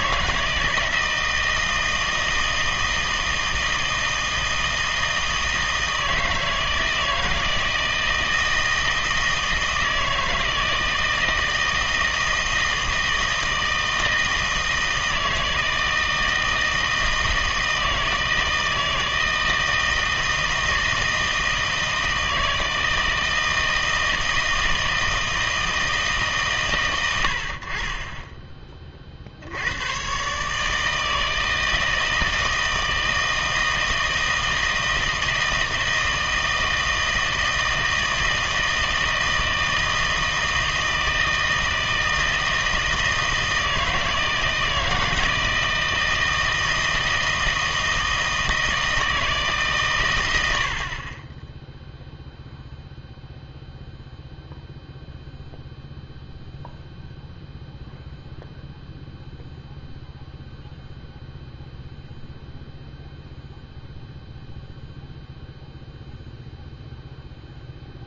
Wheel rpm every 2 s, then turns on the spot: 160, 160, 160, 160, 160, 160, 160, 160, 160, 160, 160, 160, 160, 130, 20, 150, 160, 160, 160, 160, 160, 160, 160, 160, 160, 80, 0, 0, 0, 0, 0, 0, 0, 0.
none